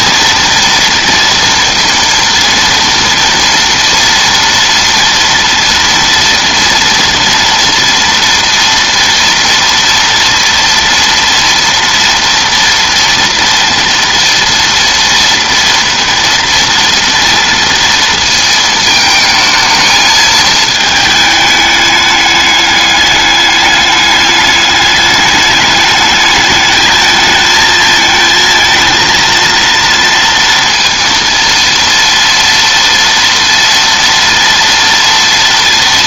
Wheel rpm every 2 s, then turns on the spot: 230, 230, 230, 230, 230, 230, 240, 240, 230, 220, 220, 210, 210, 220, 230, 230, 230, 230.
none